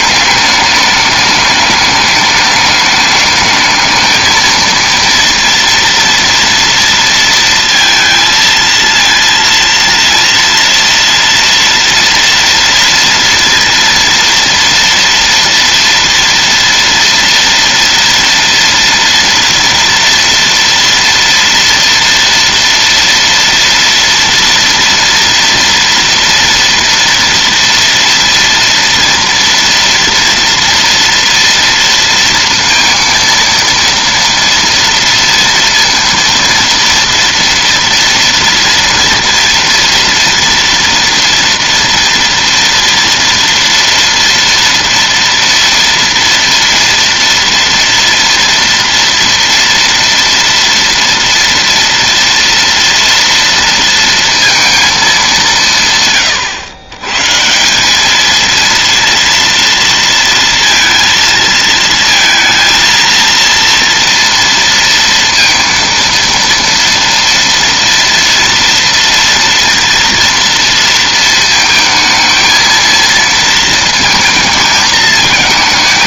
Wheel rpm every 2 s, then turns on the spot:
210, 210, 230, 230, 230, 230, 230, 230, 230, 230, 230, 230, 230, 230, 230, 230, 230, 230, 230, 240, 230, 230, 230, 240, 230, 230, 230, 230, 120, 230, 230, 230, 230, 230, 230, 230, 220, 220.
none